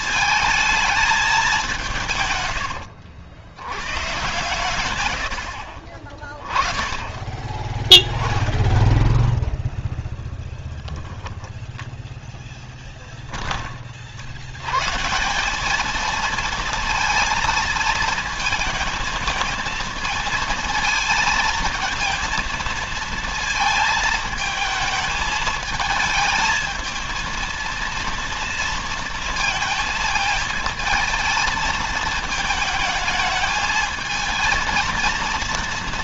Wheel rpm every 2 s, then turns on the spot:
210, 80, 120, 10, 0, 10, 10, 150, 230, 220, 230, 230, 220, 220, 230, 220, 220, 230.
none